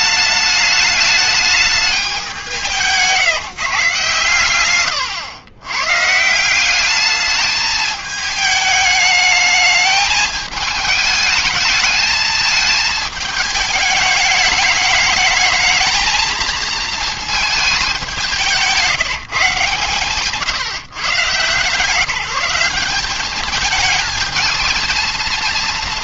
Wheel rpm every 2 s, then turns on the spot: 210, 170, 110, 180, 210, 220, 220, 210, 230, 180, 160, 180, 220.
none